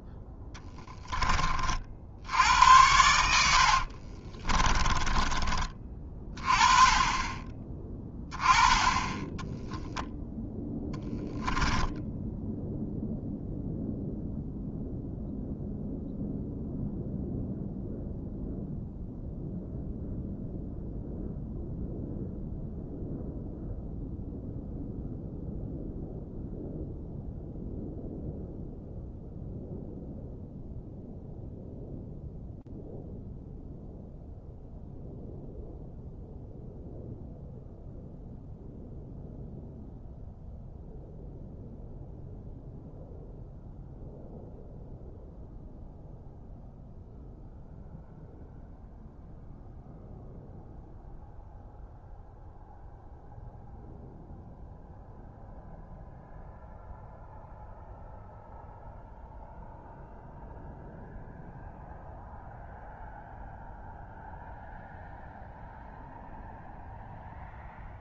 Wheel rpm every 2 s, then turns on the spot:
10, 70, 30, 30, 20, 0, 0, 0, 0, 0, 0, 0, 0, 0, 0, 0, 0, 0, 0, 0, 0, 0, 0, 0, 0, 0, 0, 0, 0, 0, 0, 0, 0, 0.
4-6